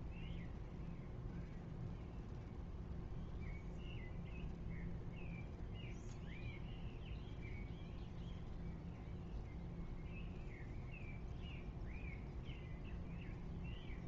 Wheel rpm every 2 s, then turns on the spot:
0, 0, 0, 0, 0, 0, 0.
none